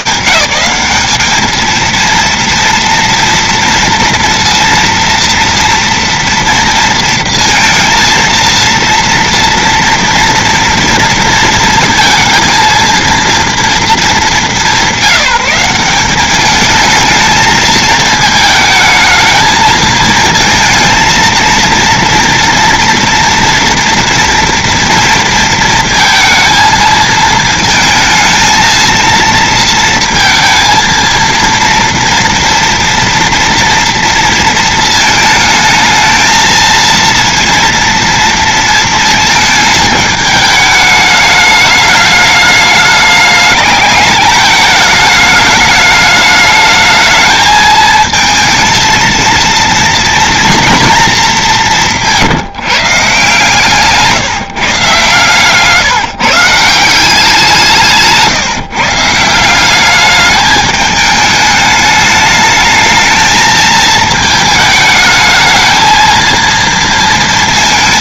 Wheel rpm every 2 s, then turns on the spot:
190, 230, 230, 230, 230, 240, 220, 220, 190, 220, 220, 230, 240, 220, 220, 230, 230, 230, 220, 230, 210, 210, 210, 210, 220, 230, 170, 150, 150, 140, 210, 210, 220, 220.
none